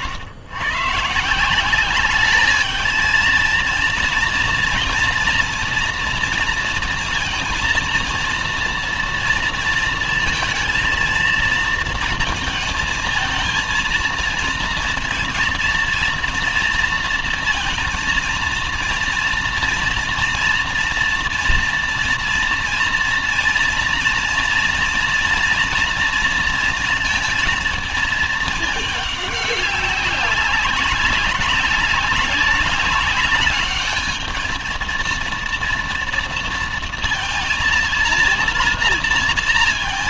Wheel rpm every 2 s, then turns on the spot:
120, 210, 230, 230, 230, 230, 230, 230, 230, 230, 230, 230, 230, 230, 210, 200, 200, 220, 230, 230.
none